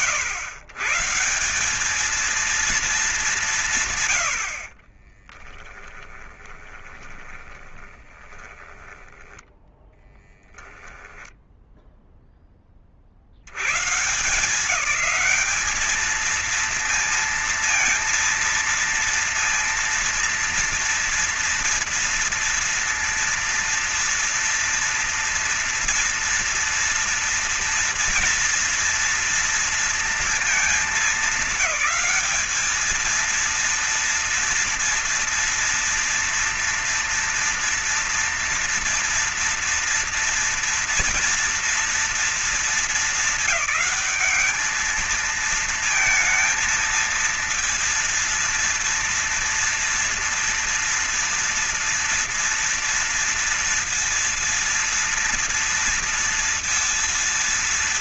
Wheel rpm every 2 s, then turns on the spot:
120, 220, 70, 20, 10, 10, 30, 180, 220, 230, 230, 230, 230, 230, 240, 220, 210, 230, 230, 230, 230, 230, 220, 230, 230, 230, 230, 230, 230.
4-12